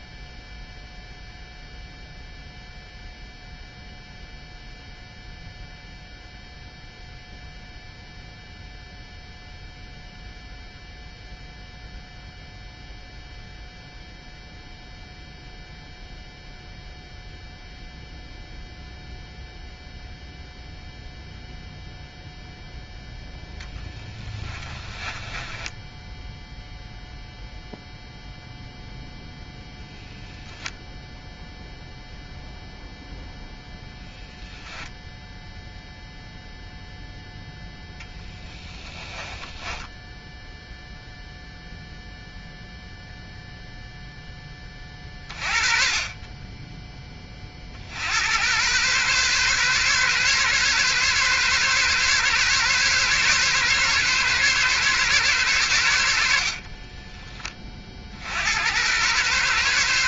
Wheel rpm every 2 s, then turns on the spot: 0, 0, 0, 0, 0, 0, 0, 0, 0, 0, 0, 0, 10, 0, 0, 0, 0, 0, 0, 20, 0, 0, 20, 20, 110, 140, 140, 140, 50, 90.
24-26 38-40 56-58